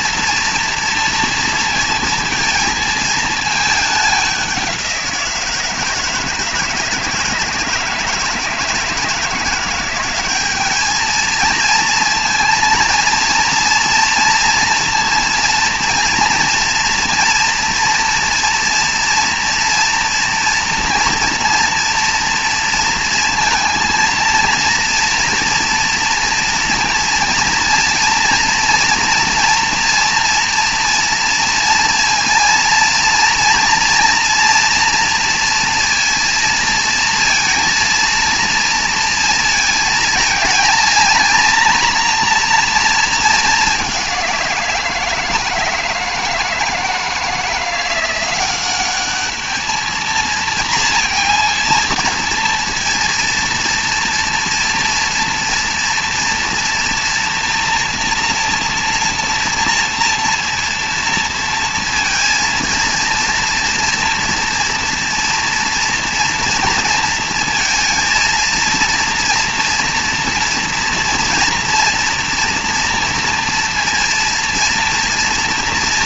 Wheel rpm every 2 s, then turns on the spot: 230, 220, 180, 160, 160, 210, 230, 230, 230, 230, 230, 230, 230, 230, 230, 230, 230, 240, 230, 230, 230, 230, 170, 160, 200, 230, 230, 230, 230, 230, 230, 230, 230, 230, 230, 240, 230, 230.
none